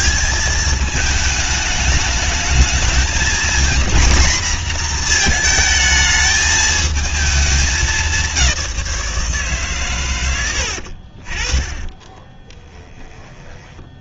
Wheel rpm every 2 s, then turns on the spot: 220, 230, 240, 220, 170, 50, 20.
none